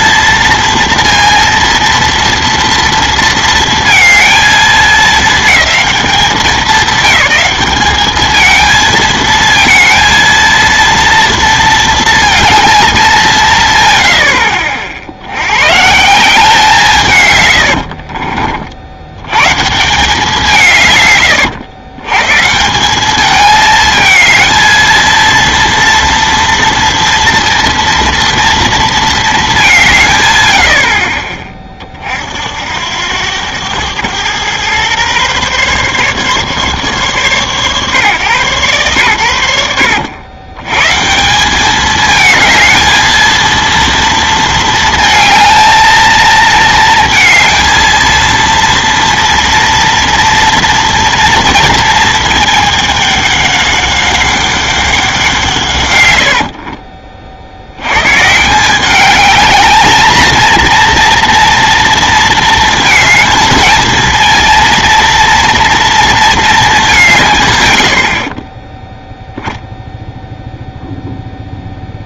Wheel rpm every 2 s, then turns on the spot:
230, 240, 220, 200, 220, 230, 220, 70, 170, 50, 160, 160, 220, 230, 230, 80, 70, 120, 140, 120, 110, 220, 230, 220, 230, 230, 220, 190, 50, 170, 230, 220, 230, 210, 20, 0.
56-58